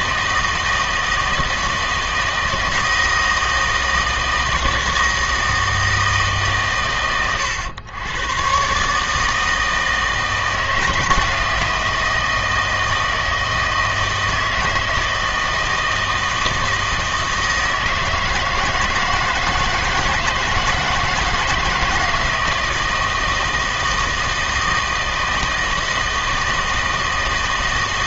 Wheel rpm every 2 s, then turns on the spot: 160, 160, 160, 140, 130, 160, 160, 160, 160, 160, 160, 160, 160, 160.
none